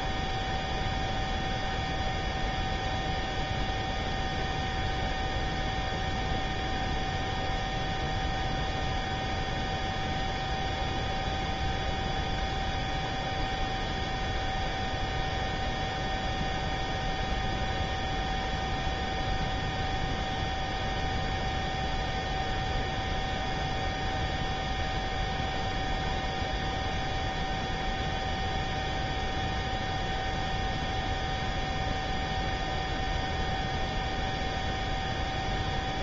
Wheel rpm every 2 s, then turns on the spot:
0, 0, 0, 0, 0, 0, 0, 0, 0, 0, 0, 0, 0, 0, 0, 0, 0, 0.
none